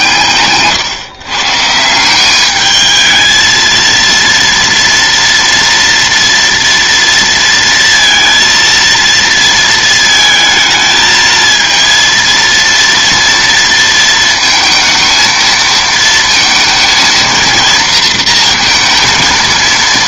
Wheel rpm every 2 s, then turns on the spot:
140, 210, 230, 230, 230, 220, 230, 230, 230, 230.
none